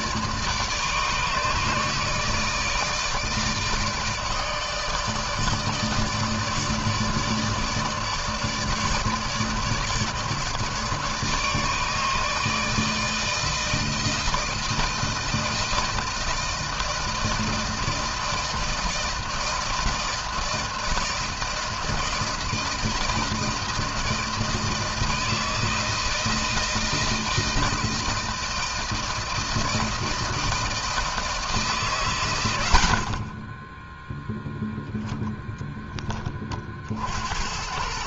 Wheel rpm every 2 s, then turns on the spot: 150, 160, 160, 150, 150, 160, 160, 160, 160, 160, 160, 160, 160, 160, 160, 160, 110, 0, 40.
none